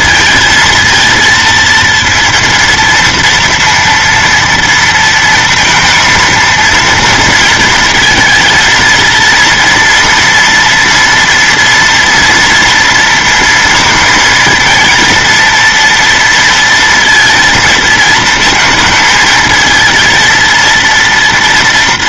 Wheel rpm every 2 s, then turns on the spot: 230, 230, 230, 230, 230, 230, 230, 230, 230, 220, 230.
none